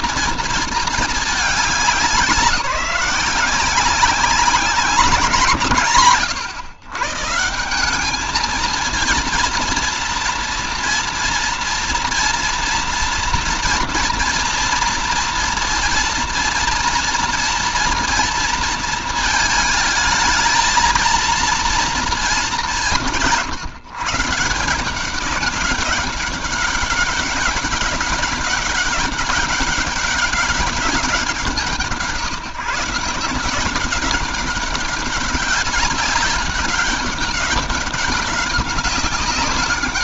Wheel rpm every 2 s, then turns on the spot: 230, 180, 190, 140, 230, 240, 240, 240, 230, 230, 220, 200, 170, 200, 190, 200, 160, 190, 200, 200.
none